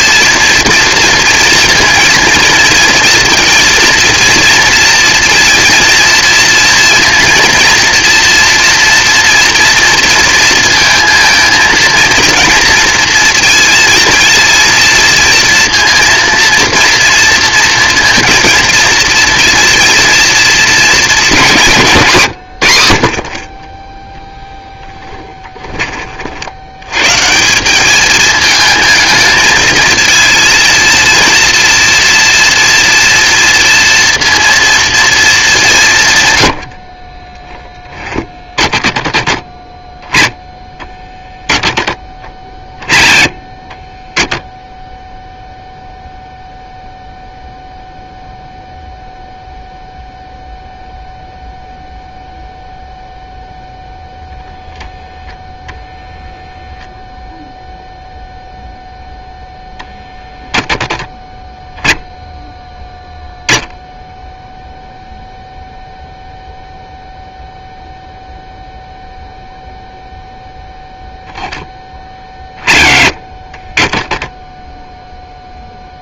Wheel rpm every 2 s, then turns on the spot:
230, 230, 230, 230, 230, 230, 230, 230, 230, 230, 220, 60, 10, 130, 220, 230, 230, 230, 40, 30, 10, 20, 0, 0, 0, 0, 0, 0, 0, 0, 0, 10, 0, 0, 0, 0, 30, 0.
24-26 36-38